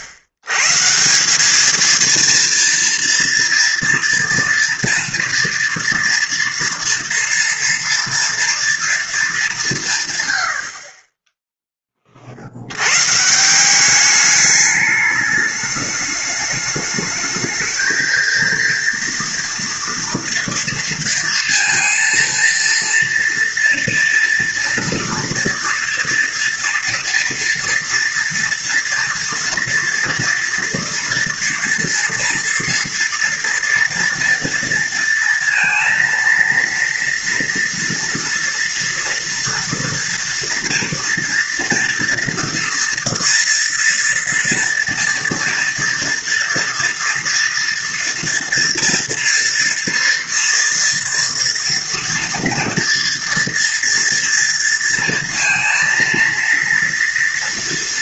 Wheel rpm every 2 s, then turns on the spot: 100, 230, 240, 230, 240, 90, 80, 210, 210, 230, 230, 230, 230, 230, 230, 230, 230, 230, 230, 230, 230, 230, 230, 230, 230, 230, 240, 230, 230.
none